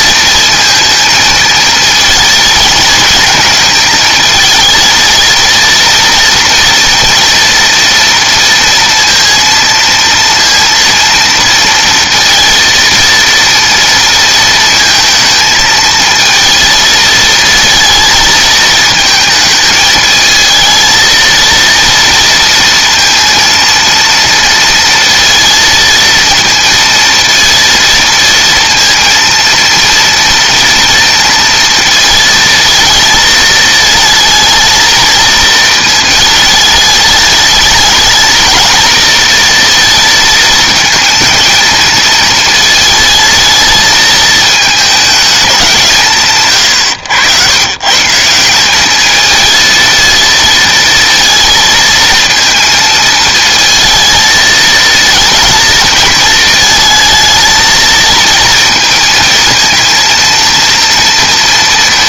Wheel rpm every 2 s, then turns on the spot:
220, 220, 220, 230, 230, 230, 230, 230, 220, 220, 220, 230, 230, 230, 230, 230, 230, 220, 220, 220, 220, 220, 220, 130, 160, 230, 220, 220, 220, 230, 230.
none